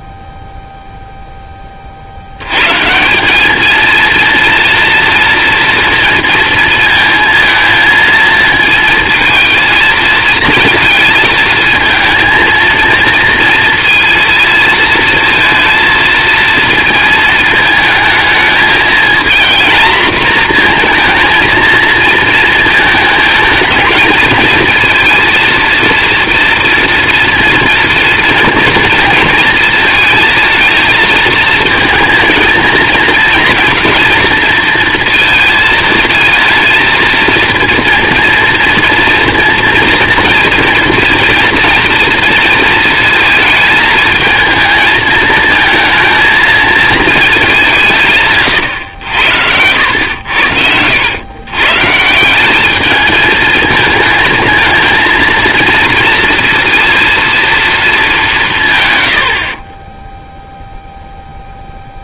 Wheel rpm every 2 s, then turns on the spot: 0, 150, 230, 230, 220, 230, 230, 220, 230, 230, 230, 220, 230, 230, 230, 220, 230, 230, 230, 230, 230, 220, 220, 230, 110, 80, 210, 220, 230, 130, 0.
48-50